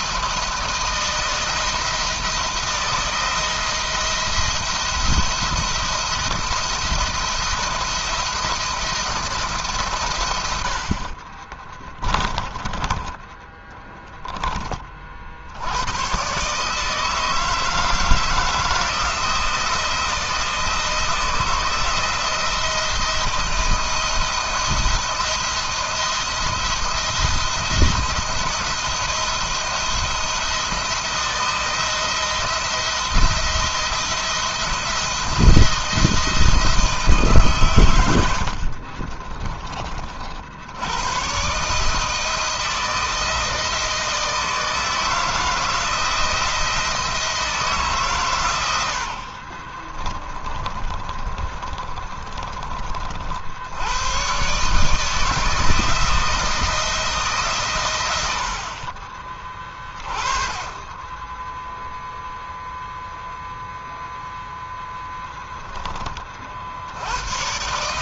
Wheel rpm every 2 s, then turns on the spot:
170, 170, 170, 170, 170, 60, 20, 40, 160, 170, 160, 160, 170, 170, 170, 170, 170, 170, 150, 40, 110, 160, 160, 160, 60, 30, 40, 150, 160, 40, 20, 0, 0, 90.
10-14 38-40 48-52 58-60